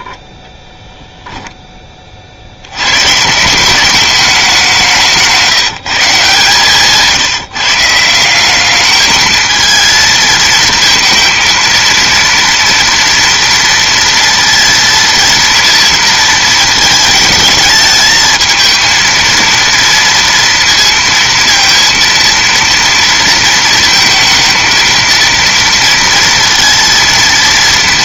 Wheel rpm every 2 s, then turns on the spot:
10, 80, 190, 150, 200, 220, 230, 230, 220, 220, 230, 230, 220, 230.
none